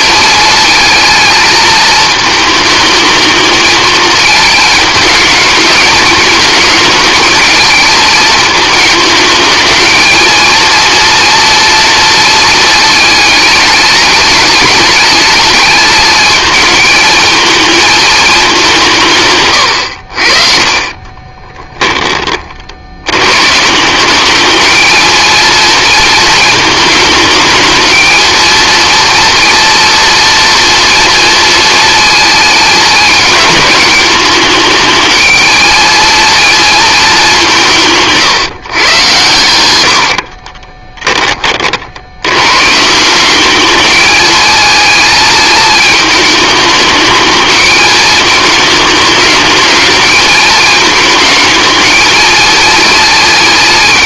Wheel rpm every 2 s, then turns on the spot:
220, 220, 220, 220, 220, 230, 220, 210, 220, 170, 40, 80, 220, 220, 230, 230, 210, 220, 220, 120, 20, 160, 220, 220, 210, 220, 220.
20-22 40-42